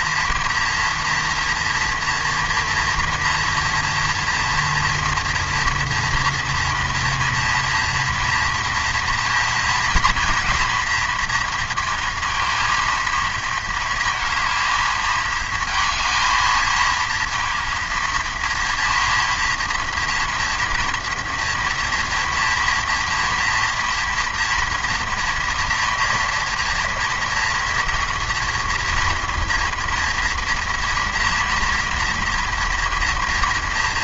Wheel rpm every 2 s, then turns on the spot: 230, 230, 230, 230, 230, 230, 230, 220, 230, 230, 230, 240, 230, 230, 230, 230, 230.
none